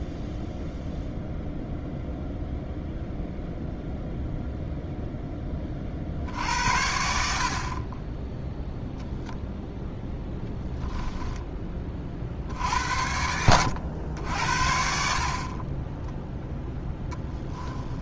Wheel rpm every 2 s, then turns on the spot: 0, 0, 0, 70, 0, 20, 70, 70, 0.
10-12